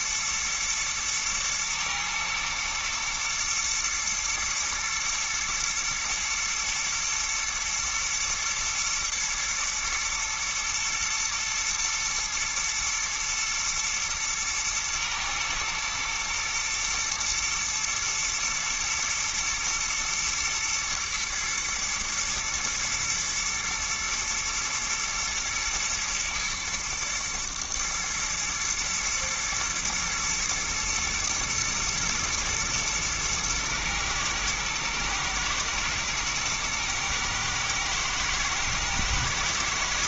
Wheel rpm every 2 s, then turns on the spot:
110, 110, 120, 110, 120, 110, 120, 110, 110, 120, 120, 120, 120, 110, 110, 110, 120, 110, 120, 110.
none